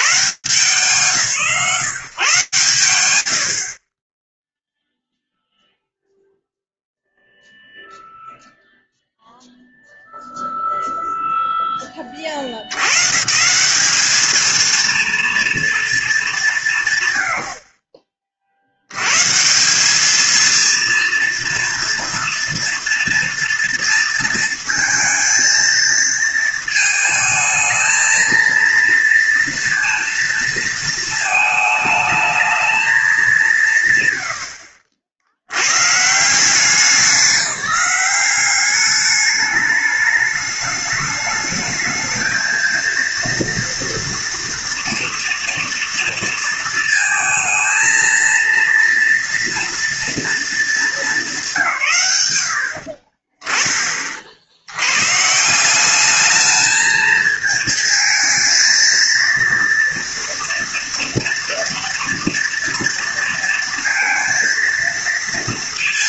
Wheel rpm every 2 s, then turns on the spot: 120, 0, 0, 0, 0, 20, 180, 220, 60, 190, 230, 230, 220, 220, 230, 220, 150, 120, 180, 210, 210, 230, 230, 230, 230, 160, 30, 180, 220, 230, 230, 230, 230.
none